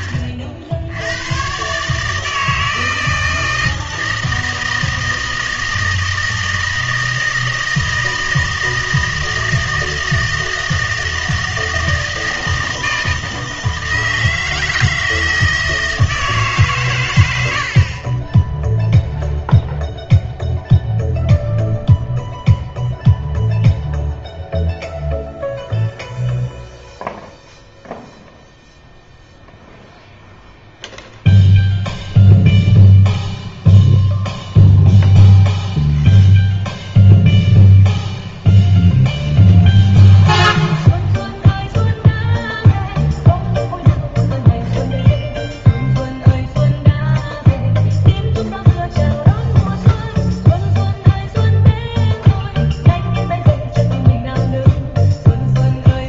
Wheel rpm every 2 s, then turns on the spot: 70, 160, 160, 160, 160, 160, 160, 160, 140, 0, 0, 0, 0, 0, 0, 0, 0, 0, 0, 0, 0, 0, 0, 0, 0, 0, 0, 0.
none